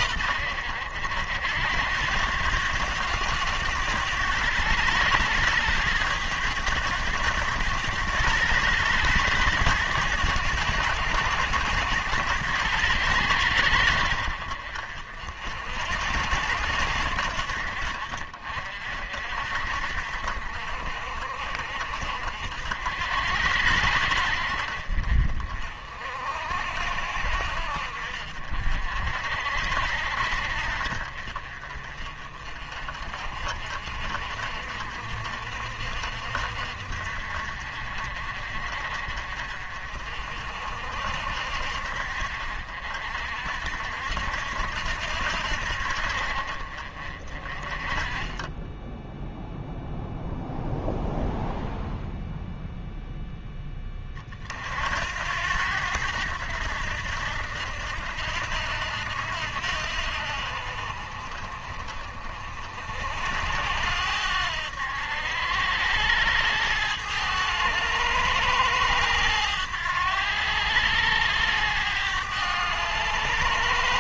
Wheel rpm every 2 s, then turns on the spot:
70, 90, 110, 100, 110, 90, 90, 60, 80, 50, 50, 70, 60, 60, 50, 50, 40, 50, 60, 50, 60, 60, 70, 40, 10, 0, 0, 70, 80, 80, 50, 60, 80, 100, 110, 100, 100.
none